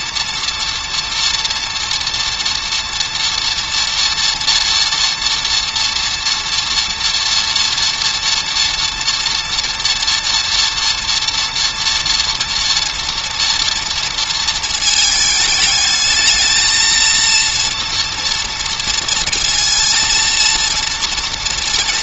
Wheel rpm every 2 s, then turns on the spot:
230, 230, 230, 230, 230, 230, 230, 220, 220, 230, 230.
none